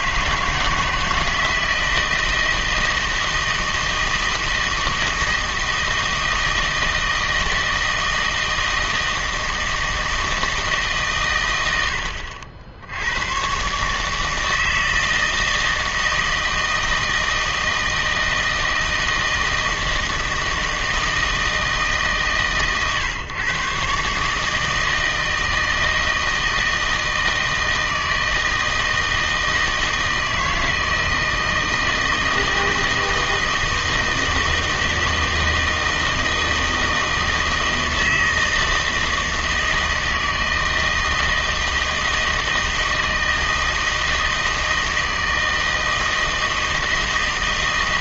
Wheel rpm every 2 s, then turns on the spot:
160, 160, 160, 160, 160, 150, 70, 160, 160, 160, 160, 130, 160, 160, 160, 160, 160, 160, 160, 160, 160, 160, 160, 160.
none